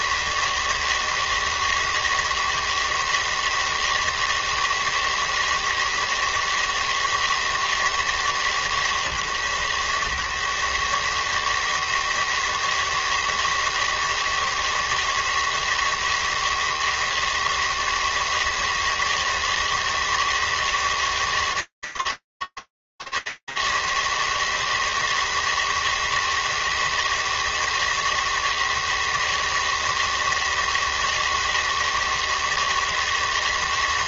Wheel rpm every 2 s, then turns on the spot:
140, 160, 160, 160, 160, 140, 160, 160, 160, 160, 160, 160, 160, 160, 160, 160, 160.
none